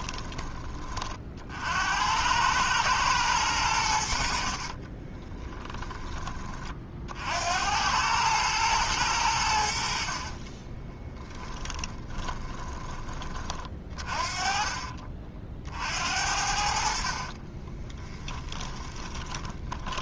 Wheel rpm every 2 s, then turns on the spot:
30, 110, 40, 50, 100, 20, 10, 30, 60, 20.
4-6 10-12 18-20